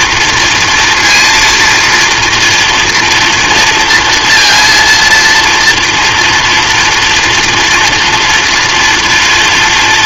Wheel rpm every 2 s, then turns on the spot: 230, 230, 230, 240, 240.
none